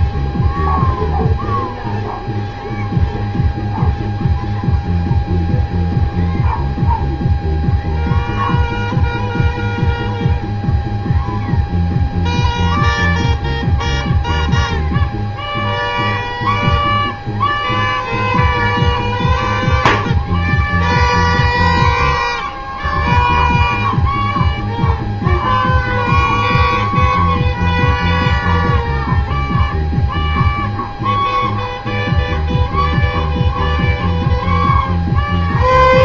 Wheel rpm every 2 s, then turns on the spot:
0, 0, 0, 0, 0, 0, 0, 0, 0, 0, 0, 0, 0, 0, 0, 0, 0, 0.
none